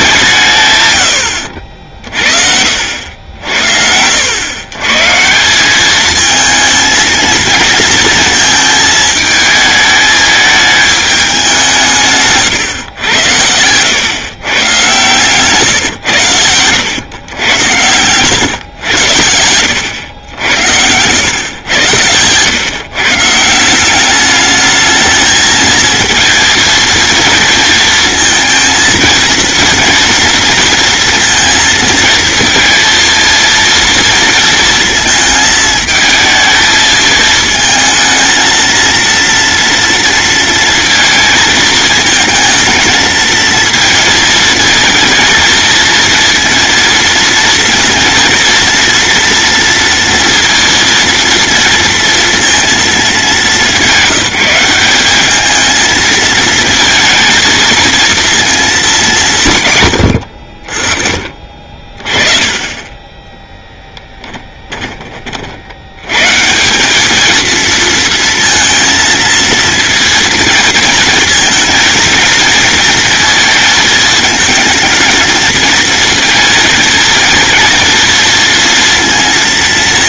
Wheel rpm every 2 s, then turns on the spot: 150, 60, 130, 230, 220, 210, 120, 120, 110, 110, 80, 130, 220, 230, 230, 230, 230, 230, 220, 230, 230, 220, 220, 230, 230, 230, 210, 190, 230, 200, 40, 20, 20, 190, 230, 230, 220, 220, 220, 230.
62-66